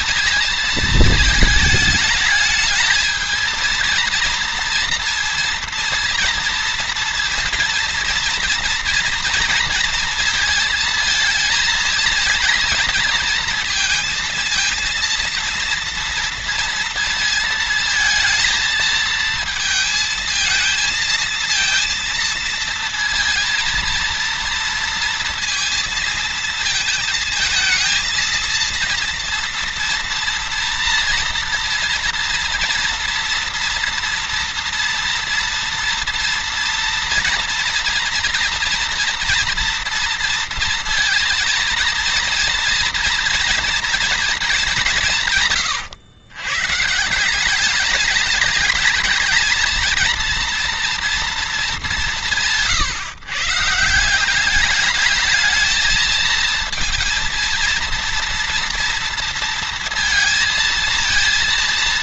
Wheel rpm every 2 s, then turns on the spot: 220, 220, 230, 230, 230, 220, 230, 230, 230, 220, 220, 230, 230, 220, 230, 230, 230, 230, 240, 240, 230, 230, 210, 140, 210, 230, 160, 190, 230, 230, 230.
none